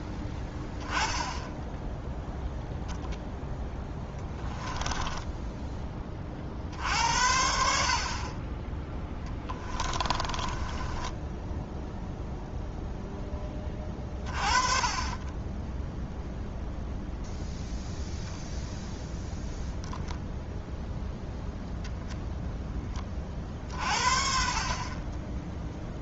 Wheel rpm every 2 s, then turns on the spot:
10, 0, 10, 60, 20, 20, 0, 30, 0, 0, 0, 10, 30.
4-6 10-12